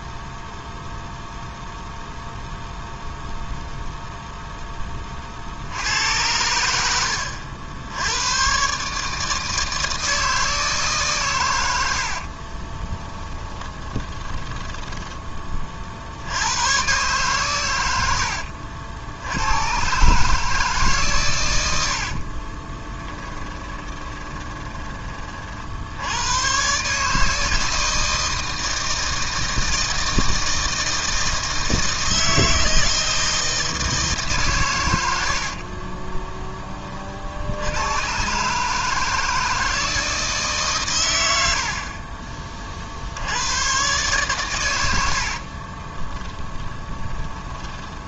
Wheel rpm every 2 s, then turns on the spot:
0, 0, 10, 80, 130, 150, 30, 20, 110, 70, 150, 20, 20, 130, 160, 160, 160, 120, 30, 150, 140, 40, 110, 20.
12-16 22-26 46-48